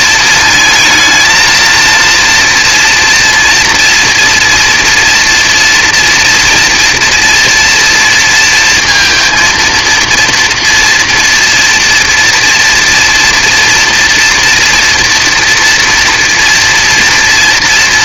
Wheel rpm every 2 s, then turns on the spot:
220, 230, 230, 230, 230, 230, 230, 230, 230.
none